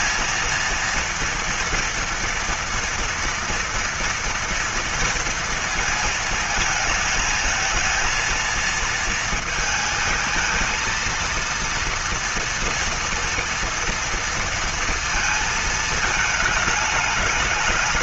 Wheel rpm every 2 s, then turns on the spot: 230, 230, 230, 220, 230, 230, 230, 230, 210.
none